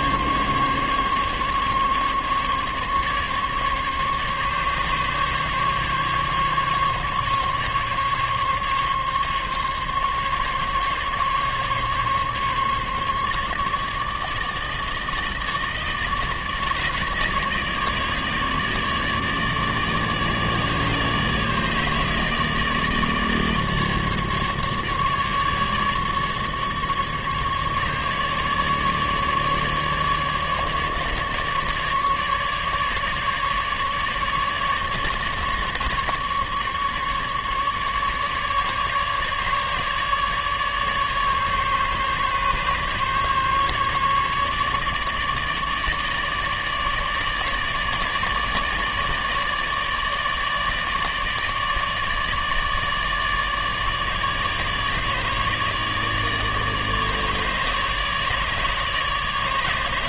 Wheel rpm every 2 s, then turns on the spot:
140, 140, 140, 140, 140, 140, 150, 160, 150, 150, 150, 150, 150, 150, 150, 150, 150, 150, 150, 150, 150, 140, 150, 150, 150, 150, 150, 150, 150, 150.
none